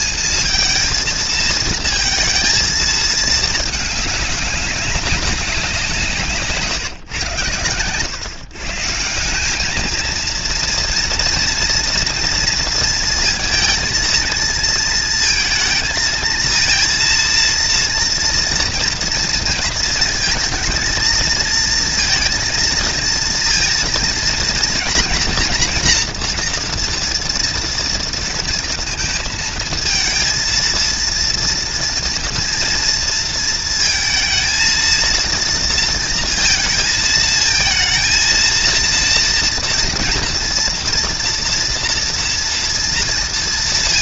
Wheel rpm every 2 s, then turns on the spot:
230, 230, 200, 150, 130, 230, 230, 230, 230, 240, 230, 230, 230, 230, 230, 220, 230, 220, 230, 230, 240, 230.
none